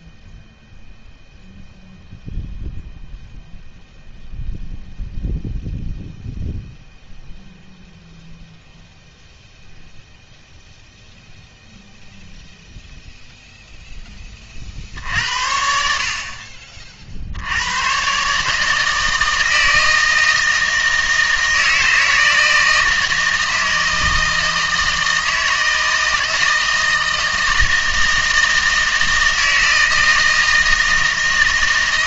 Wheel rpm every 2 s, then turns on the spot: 0, 0, 0, 0, 0, 0, 0, 50, 50, 160, 160, 160, 160, 160, 160, 160.
none